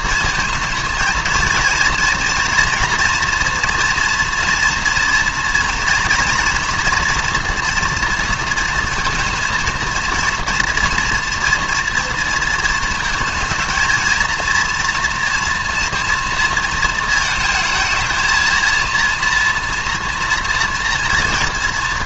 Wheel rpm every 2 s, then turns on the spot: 230, 230, 230, 230, 230, 230, 220, 230, 230, 230, 230.
none